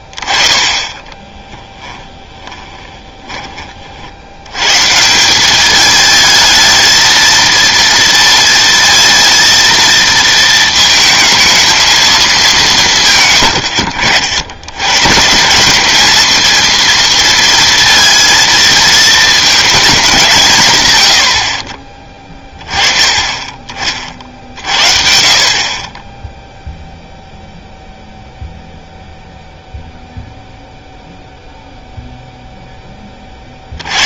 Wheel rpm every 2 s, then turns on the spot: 20, 20, 120, 220, 230, 230, 180, 100, 230, 220, 130, 20, 60, 0, 0, 0, 10.
2-4